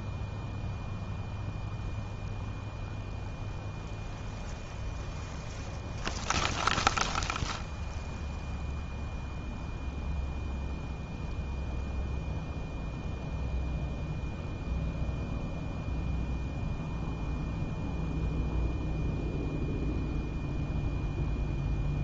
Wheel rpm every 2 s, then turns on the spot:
0, 0, 0, 0, 0, 0, 0, 0, 0, 0, 0.
none